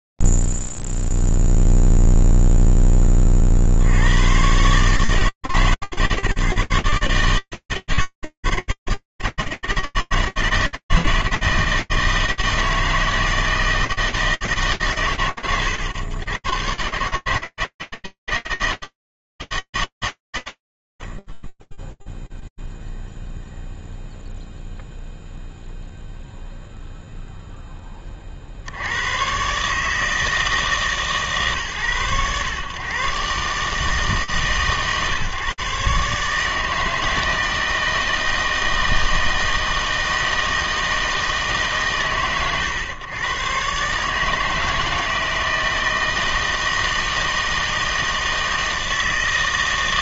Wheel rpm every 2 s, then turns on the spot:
0, 0, 70, 140, 130, 160, 160, 160, 100, 160, 100, 0, 0, 0, 60, 160, 100, 140, 150, 160, 160, 120, 160, 160, 160.
none